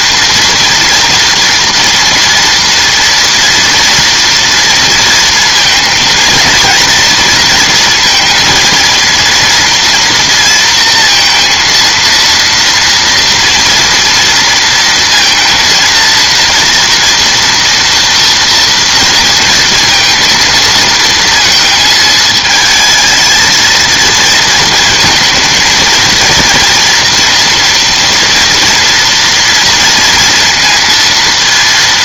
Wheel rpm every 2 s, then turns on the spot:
230, 230, 230, 230, 230, 230, 230, 230, 230, 230, 230, 220, 220, 230, 230, 230.
none